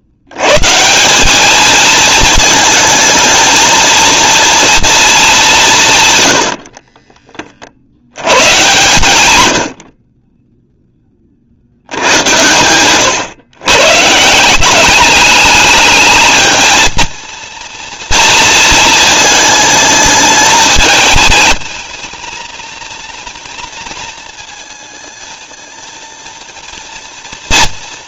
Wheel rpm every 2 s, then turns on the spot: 130, 220, 230, 50, 130, 10, 110, 190, 230, 230, 210, 230, 220, 230.
6-8